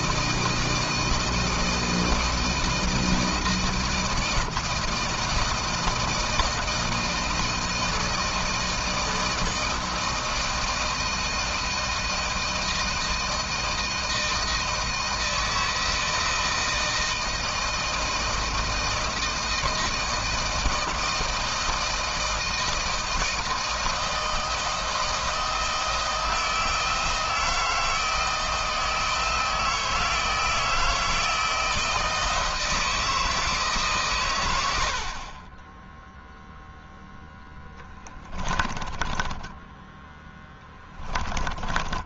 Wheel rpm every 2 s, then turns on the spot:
160, 160, 160, 160, 160, 170, 160, 160, 160, 160, 160, 160, 160, 160, 160, 160, 160, 50, 10, 20, 10.
38-42